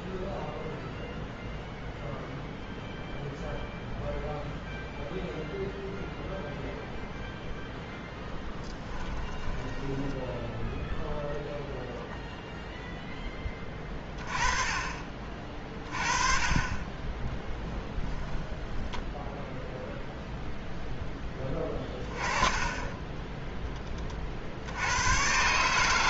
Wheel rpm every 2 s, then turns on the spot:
0, 0, 0, 0, 10, 0, 0, 30, 30, 10, 0, 20, 70.
8-10 18-20